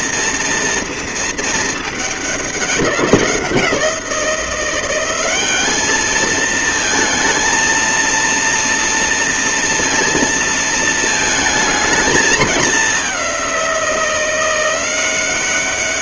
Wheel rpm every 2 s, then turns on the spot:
230, 190, 180, 230, 230, 230, 210, 180.
none